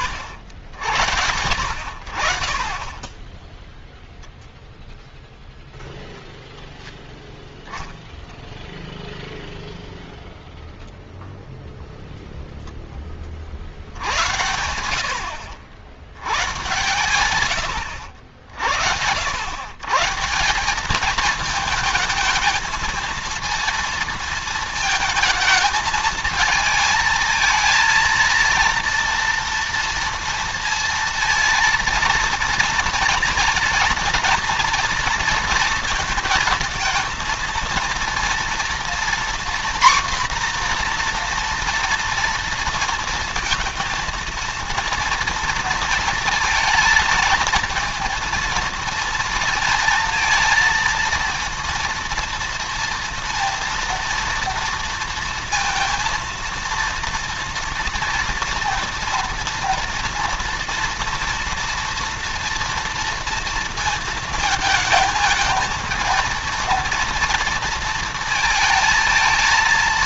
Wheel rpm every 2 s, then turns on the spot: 70, 40, 0, 0, 0, 0, 0, 80, 110, 70, 180, 220, 230, 220, 230, 230, 230, 230, 230, 230, 250, 230, 230, 230, 230, 230, 230, 230, 230, 230, 230, 230, 220, 230, 230.
none